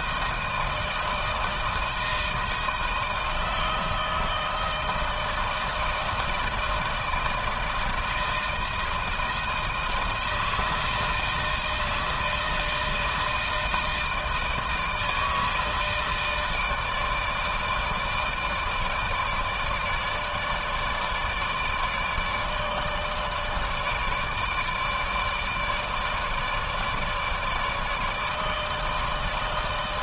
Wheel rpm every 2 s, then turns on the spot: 160, 160, 160, 160, 160, 160, 160, 160, 160, 160, 160, 150, 150, 160, 160.
none